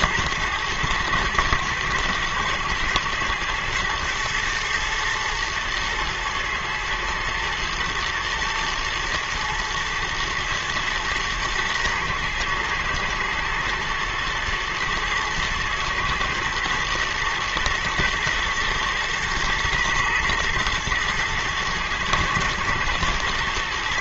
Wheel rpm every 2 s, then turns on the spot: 110, 110, 110, 110, 110, 120, 110, 110, 110, 120, 110, 110.
none